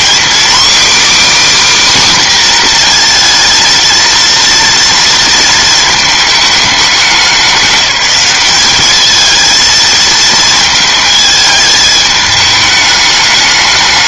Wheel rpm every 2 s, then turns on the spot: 280, 250, 230, 210, 210, 220, 210.
none